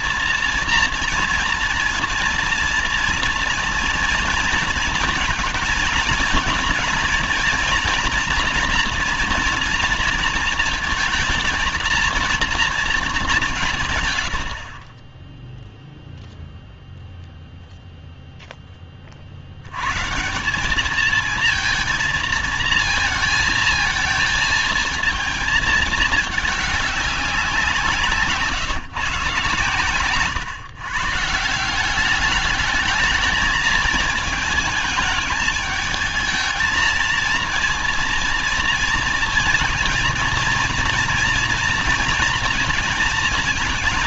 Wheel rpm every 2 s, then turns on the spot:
230, 230, 230, 240, 230, 230, 230, 80, 0, 10, 170, 230, 230, 210, 160, 140, 210, 220, 220, 230, 230, 230.
none